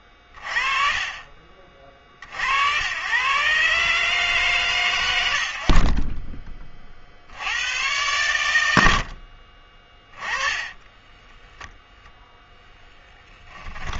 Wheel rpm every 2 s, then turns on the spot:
20, 90, 150, 20, 120, 20, 10.
10-14